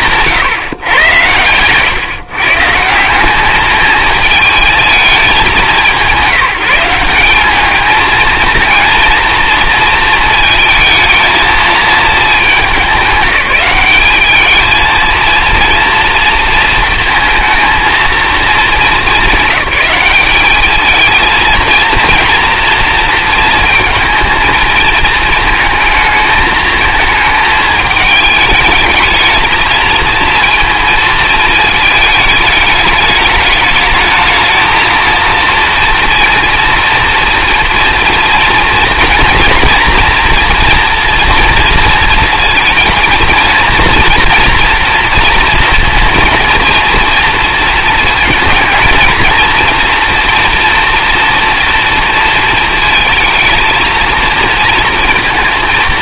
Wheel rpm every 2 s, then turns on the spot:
150, 150, 220, 190, 230, 220, 210, 220, 230, 200, 210, 230, 220, 220, 220, 230, 210, 220, 230, 230, 230, 230, 240, 230, 230, 230, 230, 230.
none